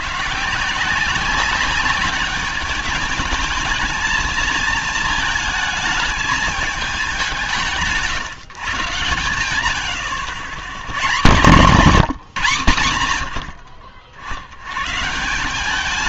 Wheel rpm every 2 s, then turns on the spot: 160, 210, 220, 220, 140, 90, 150, 80.
none